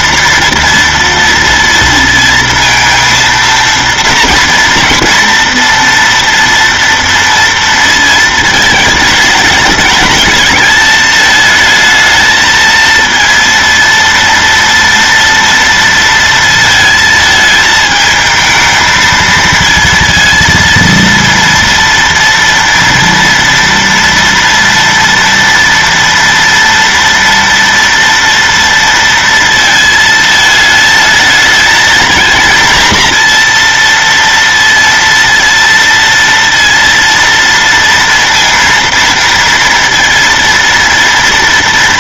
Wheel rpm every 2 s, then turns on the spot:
230, 230, 230, 240, 220, 210, 220, 230, 230, 220, 230, 230, 230, 230, 230, 220, 230, 230, 230, 230, 230.
none